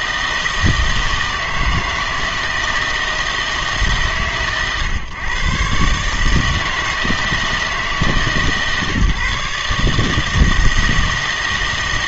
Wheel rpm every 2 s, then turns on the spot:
160, 160, 130, 160, 140, 160.
none